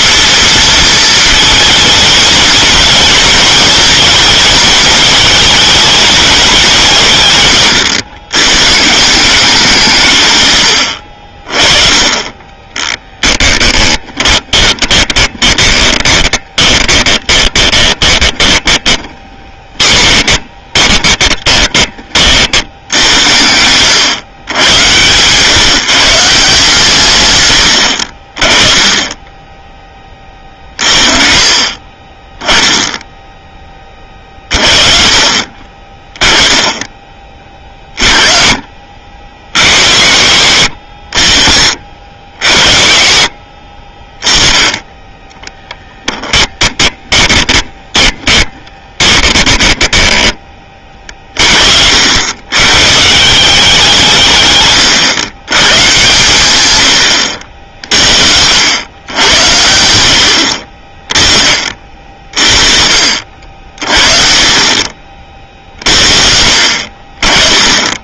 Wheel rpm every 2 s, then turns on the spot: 230, 220, 220, 200, 130, 110, 20, 20, 20, 20, 20, 70, 110, 150, 20, 40, 10, 40, 10, 40, 80, 60, 10, 10, 20, 30, 120, 130, 110, 90, 40, 40, 40, 50.
14-22 46-50